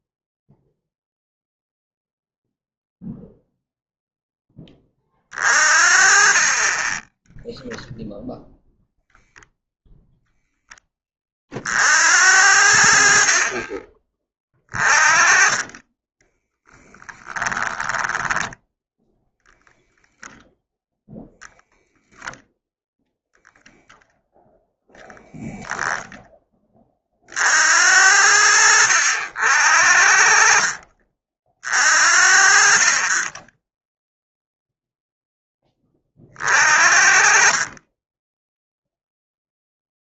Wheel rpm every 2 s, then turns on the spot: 0, 0, 20, 10, 0, 20, 40, 20, 10, 0, 0, 0, 0, 30, 60, 50, 40, 0, 40, 0.
6-8 12-14